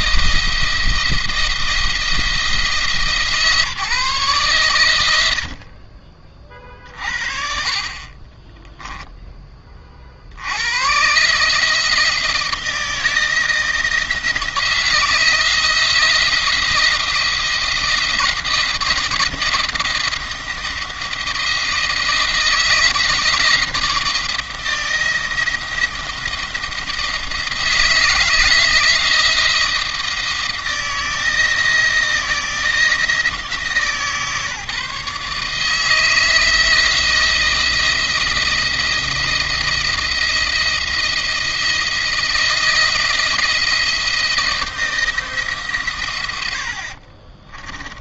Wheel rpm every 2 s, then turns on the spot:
170, 160, 110, 40, 10, 100, 160, 160, 160, 170, 170, 160, 170, 170, 170, 160, 160, 150, 160, 160, 170, 170, 170, 70.
46-48